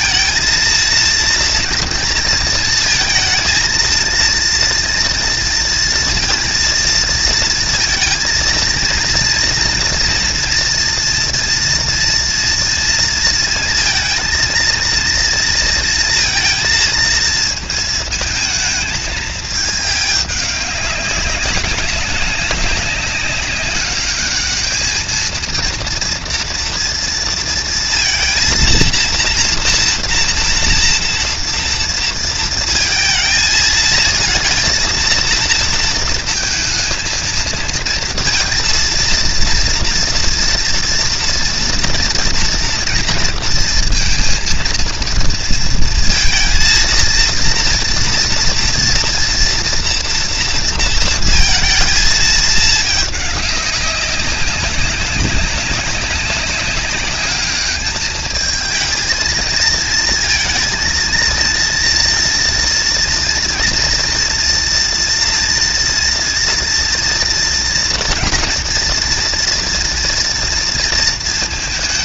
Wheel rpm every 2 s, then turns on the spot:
230, 230, 230, 230, 230, 230, 230, 230, 230, 220, 200, 190, 220, 230, 230, 230, 220, 230, 230, 230, 230, 230, 230, 230, 230, 230, 210, 190, 200, 220, 230, 230, 230, 230, 230, 230.
none